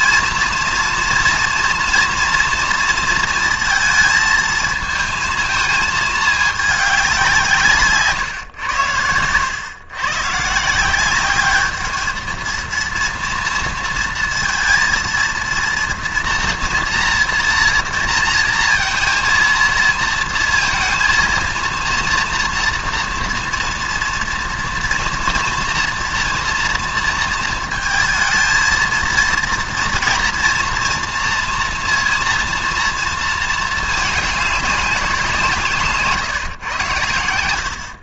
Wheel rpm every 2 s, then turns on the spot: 230, 230, 220, 210, 120, 150, 230, 230, 240, 230, 230, 230, 230, 230, 220, 230, 230, 200, 130.
none